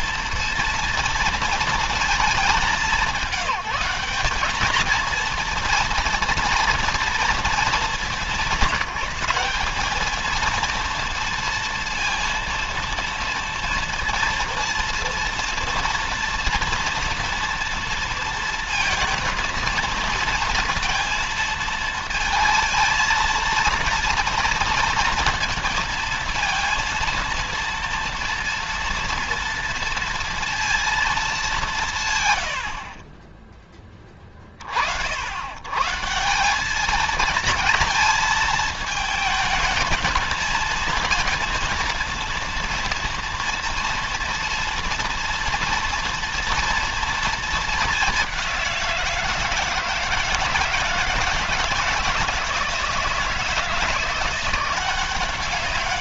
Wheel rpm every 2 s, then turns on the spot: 230, 200, 230, 230, 190, 230, 230, 230, 230, 230, 230, 230, 230, 230, 230, 220, 50, 60, 200, 220, 230, 230, 230, 230, 170, 160, 160, 180.
none